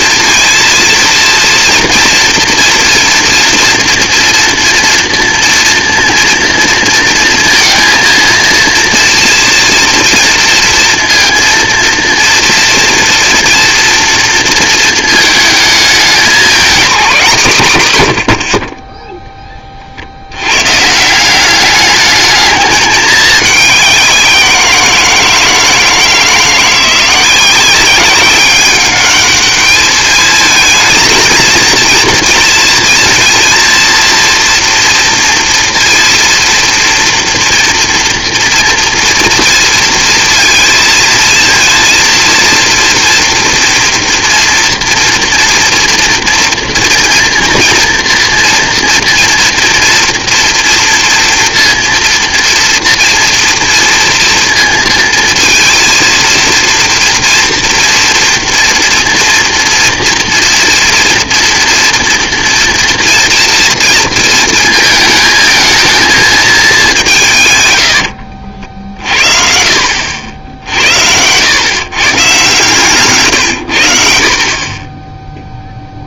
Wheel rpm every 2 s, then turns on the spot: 230, 230, 230, 230, 230, 230, 230, 230, 230, 50, 130, 210, 180, 170, 200, 220, 230, 230, 230, 230, 220, 230, 230, 240, 230, 230, 230, 230, 230, 240, 240, 230, 220, 210, 50, 70, 140, 50.
none